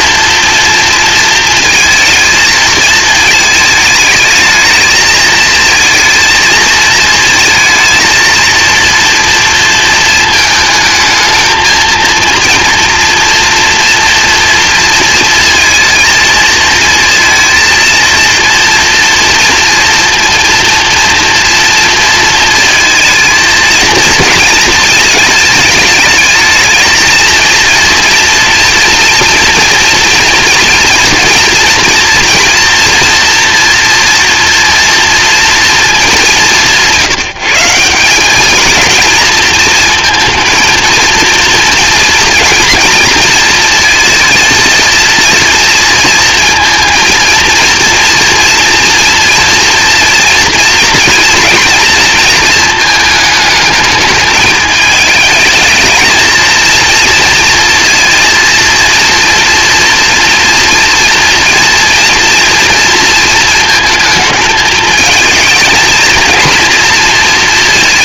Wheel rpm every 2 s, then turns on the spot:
230, 220, 220, 220, 230, 220, 230, 230, 230, 230, 230, 220, 220, 220, 230, 230, 230, 230, 180, 230, 220, 230, 230, 230, 230, 230, 220, 210, 230, 240, 230, 220, 220, 230.
none